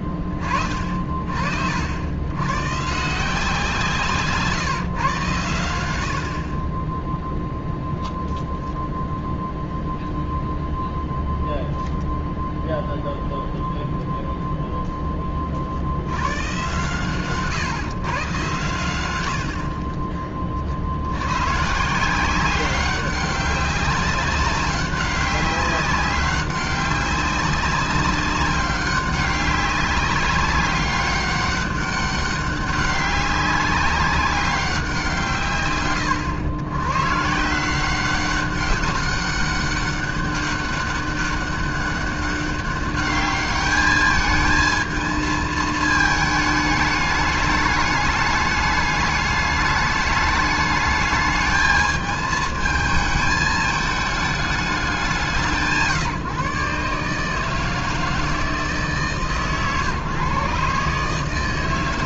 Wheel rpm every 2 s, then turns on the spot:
40, 90, 160, 70, 0, 0, 0, 0, 130, 130, 40, 190, 190, 190, 200, 200, 200, 190, 120, 190, 200, 200, 220, 210, 210, 210, 220, 210, 150, 160, 140.
none